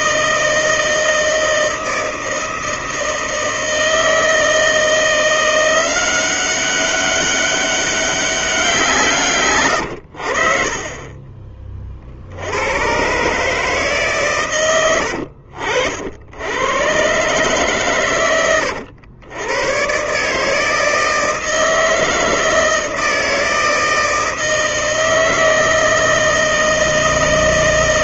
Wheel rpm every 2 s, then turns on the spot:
160, 160, 170, 190, 170, 40, 120, 90, 120, 110, 160, 160, 160, 160.
10-12 14-16